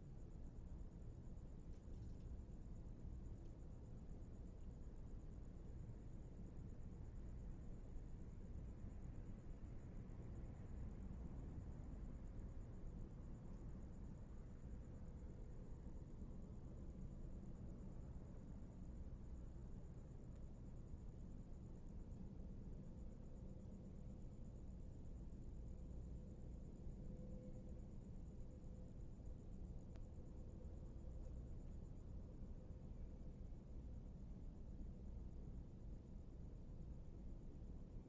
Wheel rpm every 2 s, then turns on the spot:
0, 0, 0, 0, 0, 0, 0, 0, 0, 0, 0, 0, 0, 0, 0, 0, 0, 0, 0.
none